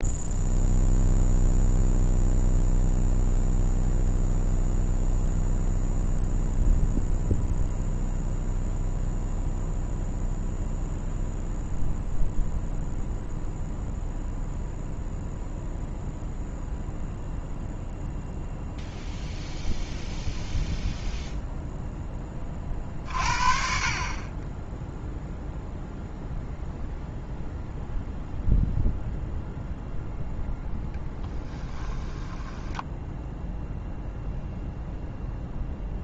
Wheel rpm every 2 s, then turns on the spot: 0, 0, 0, 0, 0, 0, 0, 0, 0, 0, 0, 40, 0, 0, 0, 0, 10, 0.
32-34